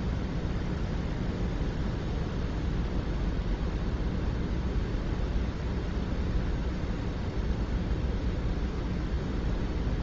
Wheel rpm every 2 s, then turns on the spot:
0, 0, 0, 0, 0.
none